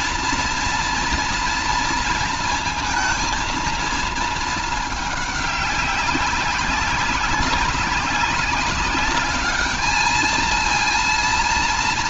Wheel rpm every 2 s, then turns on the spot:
230, 230, 220, 200, 210, 230.
none